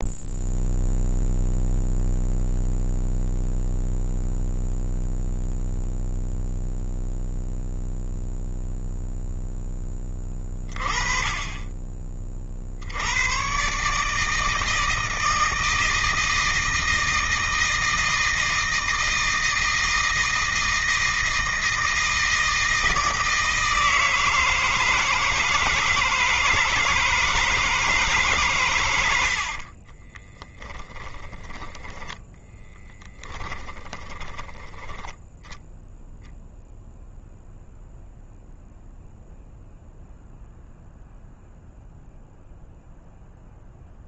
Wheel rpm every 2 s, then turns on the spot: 0, 0, 0, 0, 0, 20, 80, 160, 160, 160, 160, 160, 160, 160, 90, 10, 10, 10, 0, 0, 0, 0.
30-34